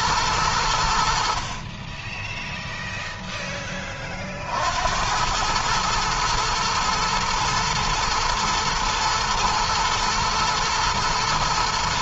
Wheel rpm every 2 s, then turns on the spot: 70, 0, 80, 120, 110, 110.
none